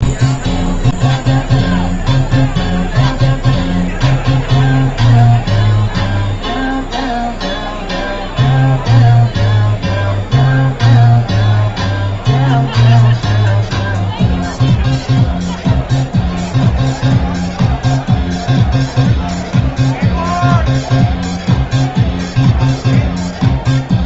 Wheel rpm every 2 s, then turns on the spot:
0, 0, 0, 0, 0, 0, 0, 0, 0, 0, 0, 0.
none